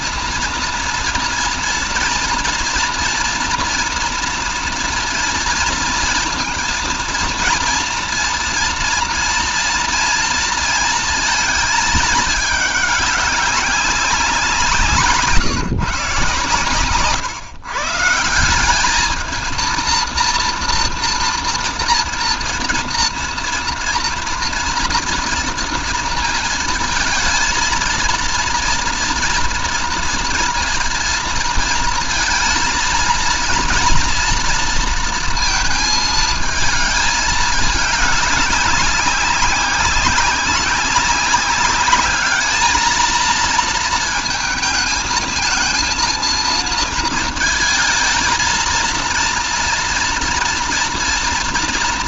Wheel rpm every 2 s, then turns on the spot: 230, 230, 230, 230, 240, 230, 200, 170, 130, 200, 230, 230, 230, 230, 230, 230, 230, 230, 220, 200, 200, 220, 220, 230, 230, 230.
16-18